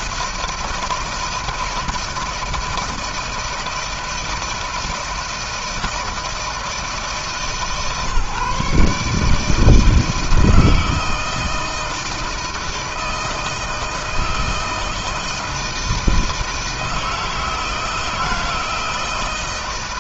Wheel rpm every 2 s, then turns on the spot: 160, 160, 160, 160, 140, 160, 160, 160, 160, 160.
none